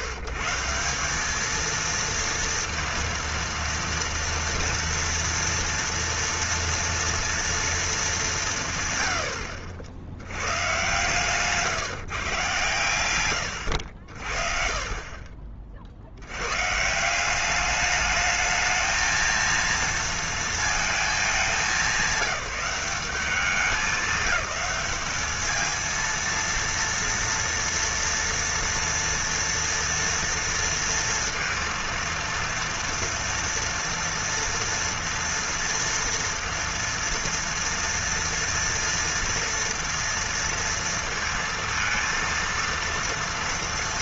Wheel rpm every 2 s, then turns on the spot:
160, 230, 230, 230, 140, 110, 110, 40, 150, 220, 220, 180, 190, 230, 230, 230, 230, 230, 230, 230, 230, 230.
none